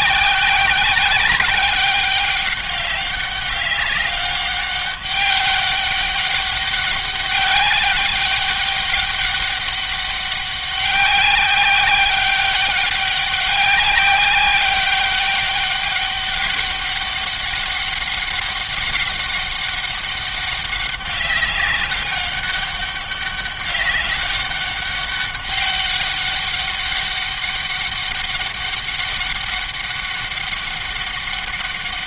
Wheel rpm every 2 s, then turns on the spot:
190, 200, 200, 200, 200, 190, 200, 200, 200, 200, 200, 200, 200, 200, 200, 200.
none